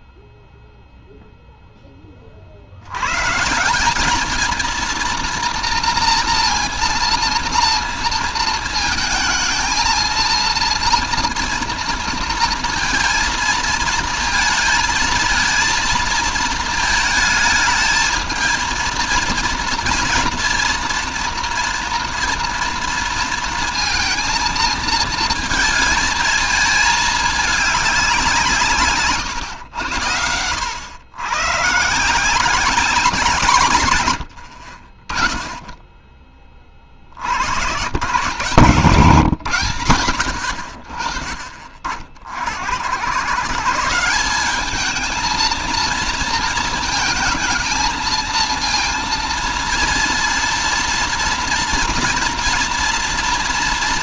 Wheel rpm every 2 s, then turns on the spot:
0, 70, 230, 230, 230, 230, 230, 230, 220, 220, 230, 230, 230, 220, 150, 90, 180, 60, 40, 140, 70, 80, 210, 230, 230, 230, 240.
none